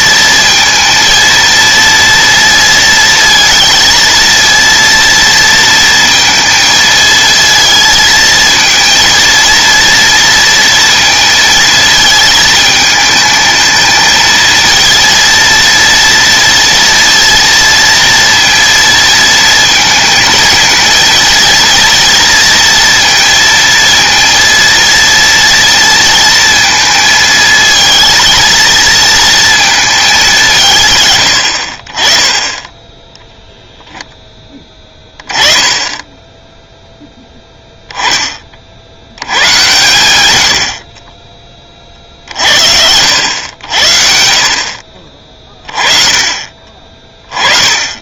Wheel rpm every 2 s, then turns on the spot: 230, 230, 230, 230, 230, 230, 220, 230, 230, 230, 230, 230, 230, 230, 220, 160, 10, 10, 0, 60, 50, 70, 40, 30.
none